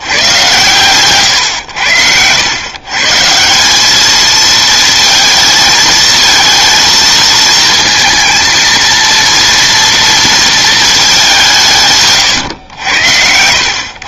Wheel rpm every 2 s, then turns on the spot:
130, 120, 230, 230, 230, 220, 100.
none